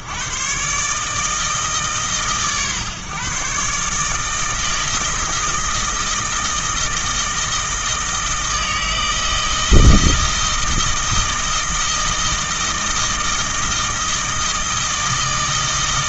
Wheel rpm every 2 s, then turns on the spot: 140, 130, 160, 160, 160, 160, 160, 160.
none